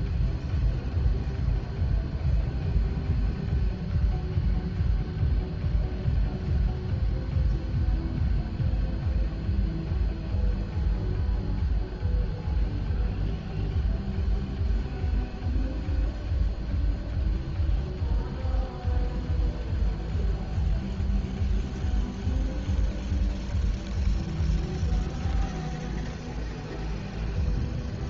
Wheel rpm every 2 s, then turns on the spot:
0, 0, 0, 0, 0, 0, 0, 0, 0, 0, 0, 0, 0, 0.
none